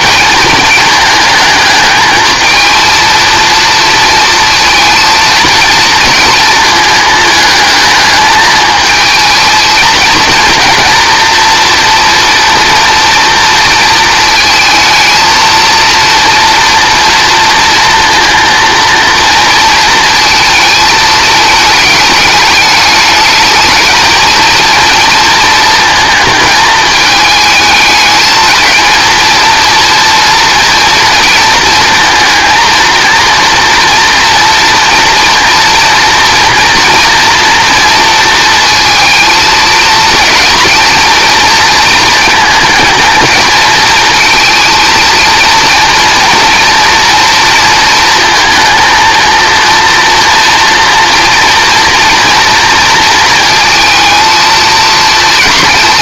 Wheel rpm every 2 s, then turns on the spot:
220, 230, 230, 220, 220, 230, 230, 220, 230, 230, 220, 210, 230, 220, 220, 230, 230, 230, 240, 230, 230, 220, 230, 230, 220, 230, 230, 230.
none